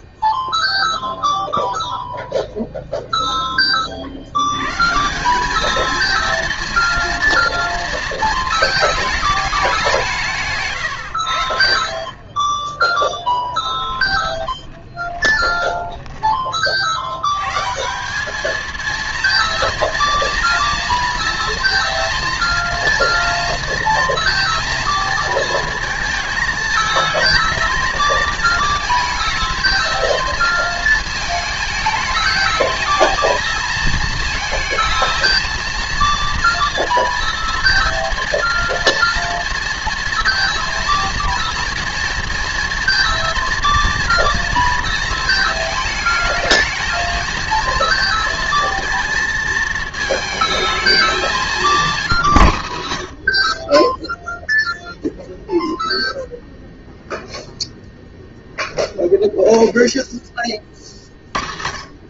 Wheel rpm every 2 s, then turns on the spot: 0, 0, 130, 230, 220, 120, 10, 30, 50, 230, 240, 230, 230, 220, 230, 220, 220, 230, 230, 230, 230, 240, 230, 220, 230, 220, 80, 0, 0, 0, 20.
14-16